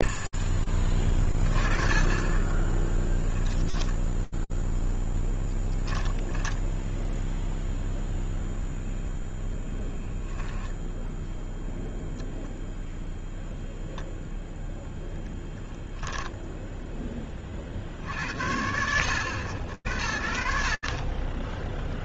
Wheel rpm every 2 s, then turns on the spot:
30, 10, 0, 0, 0, 0, 0, 20, 30, 70, 10.
none